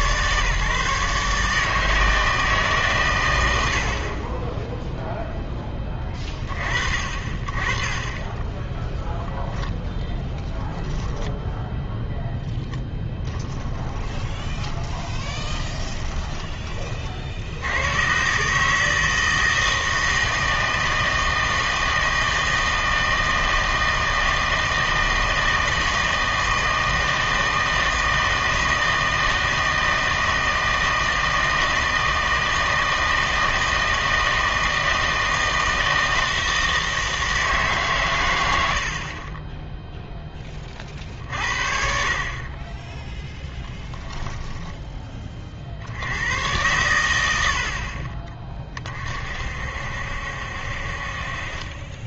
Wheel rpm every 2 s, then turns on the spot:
150, 140, 10, 30, 10, 0, 0, 20, 30, 160, 160, 160, 160, 160, 160, 160, 160, 160, 160, 70, 40, 20, 20, 110, 30, 60.
14-16